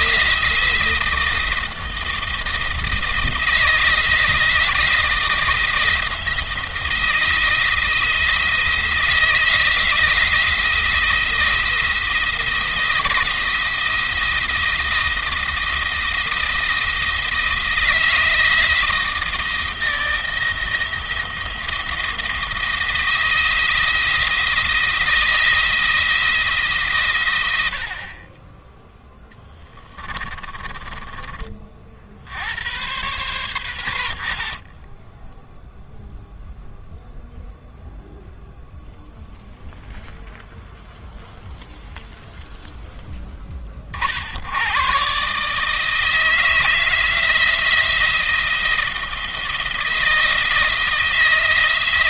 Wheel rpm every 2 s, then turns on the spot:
160, 170, 170, 170, 160, 170, 160, 170, 170, 160, 170, 170, 170, 130, 10, 30, 120, 40, 0, 0, 0, 0, 110, 160, 170, 160.
30-32